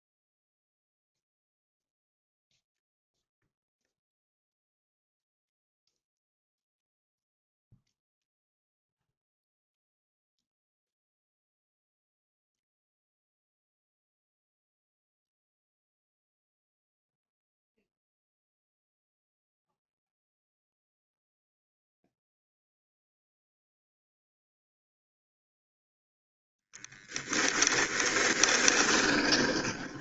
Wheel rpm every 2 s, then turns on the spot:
0, 0, 0, 0, 0, 0, 0, 0, 0, 0, 0, 0, 0, 10, 20.
26-30